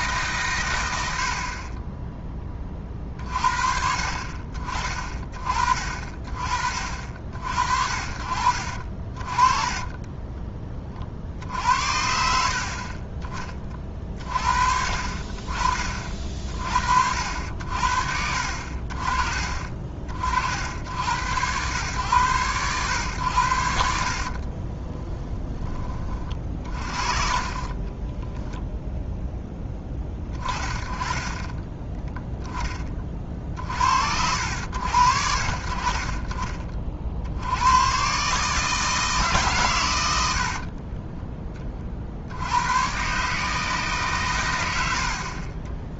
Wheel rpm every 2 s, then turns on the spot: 100, 30, 40, 40, 60, 20, 40, 40, 50, 50, 70, 110, 30, 40, 0, 20, 20, 60, 40, 150, 30, 100, 110.
8-10 24-26 40-42